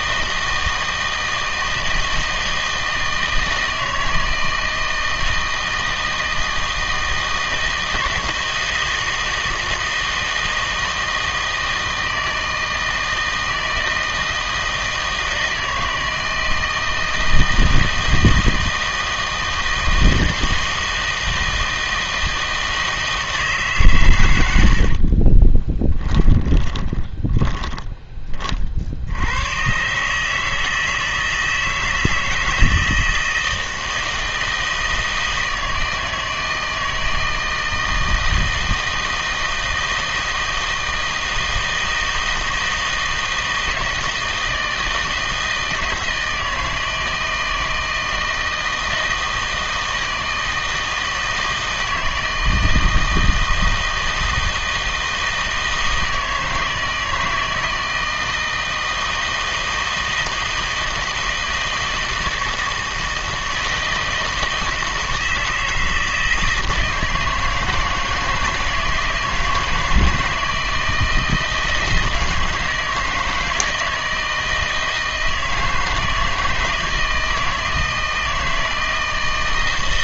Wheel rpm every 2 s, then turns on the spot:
160, 160, 160, 160, 160, 160, 160, 160, 160, 160, 160, 160, 80, 20, 50, 160, 160, 160, 160, 160, 160, 160, 160, 160, 160, 160, 160, 160, 160, 160, 160, 160, 160, 160, 160, 160, 160, 160, 160, 160.
26-28